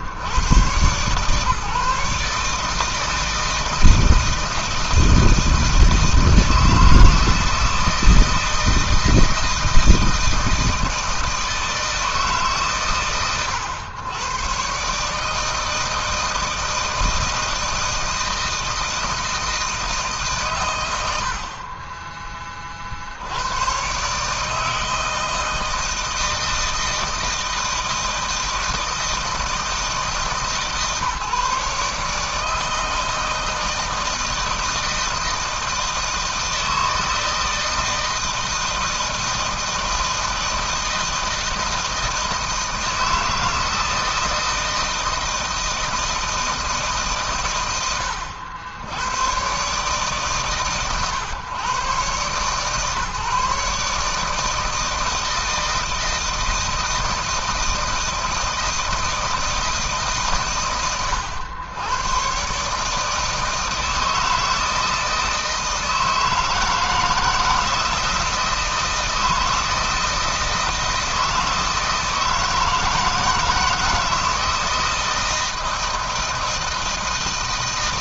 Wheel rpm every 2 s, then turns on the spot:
140, 160, 160, 160, 160, 160, 110, 150, 160, 160, 70, 80, 160, 160, 160, 150, 160, 160, 160, 160, 160, 160, 160, 120, 110, 130, 140, 160, 160, 160, 100, 160, 160, 160, 160, 160, 160, 160, 160.
none